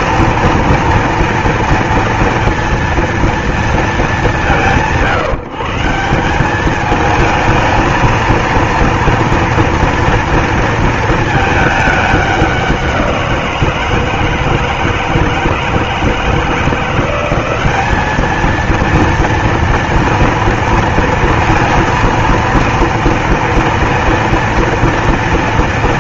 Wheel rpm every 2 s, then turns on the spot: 230, 230, 170, 190, 230, 230, 190, 160, 160, 220, 230, 230, 230.
none